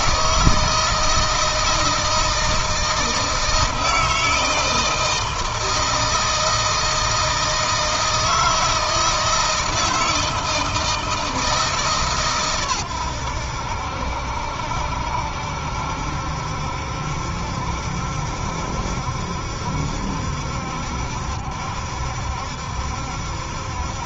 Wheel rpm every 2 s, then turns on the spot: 160, 160, 160, 160, 160, 160, 110, 70, 70, 70, 70, 70.
none